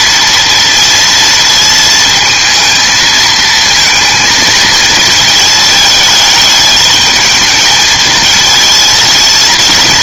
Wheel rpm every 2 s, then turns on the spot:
230, 230, 230, 210, 220.
none